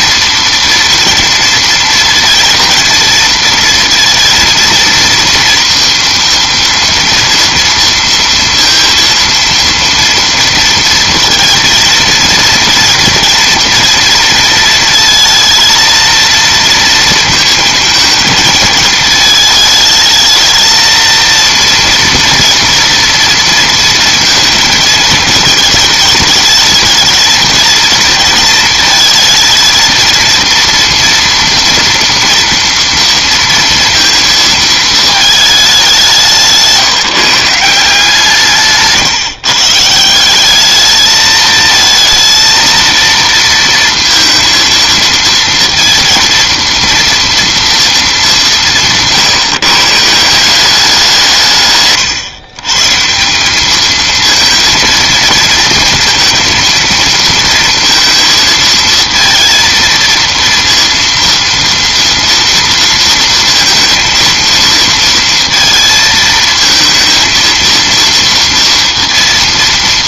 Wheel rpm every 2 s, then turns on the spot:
230, 230, 230, 230, 230, 230, 230, 230, 230, 220, 220, 230, 220, 220, 230, 230, 230, 230, 170, 150, 200, 230, 230, 230, 170, 180, 140, 230, 230, 220, 230, 230, 230, 230, 230.
none